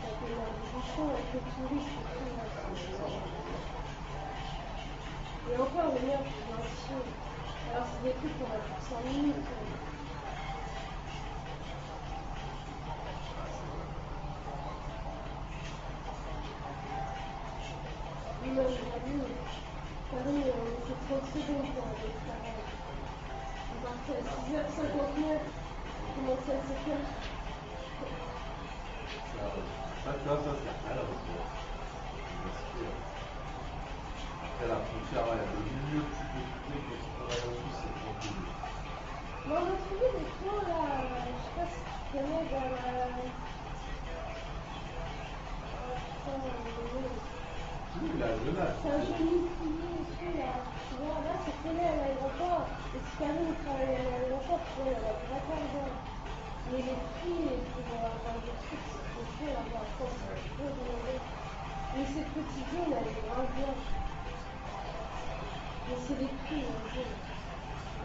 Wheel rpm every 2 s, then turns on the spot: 0, 0, 0, 0, 0, 0, 0, 0, 0, 0, 0, 0, 0, 0, 0, 0, 0, 0, 0, 0, 0, 0, 0, 0, 0, 0, 0, 0, 0, 0, 0, 0, 0, 0.
none